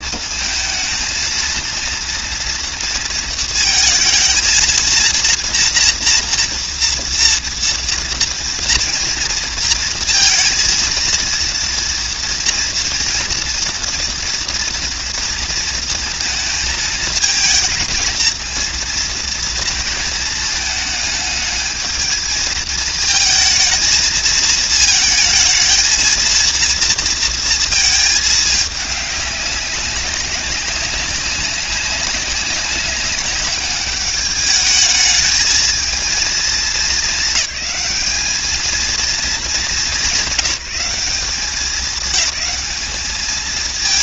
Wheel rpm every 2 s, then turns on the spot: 230, 230, 230, 230, 230, 230, 230, 230, 220, 230, 210, 220, 220, 230, 200, 190, 200, 210, 220, 220, 200, 220.
none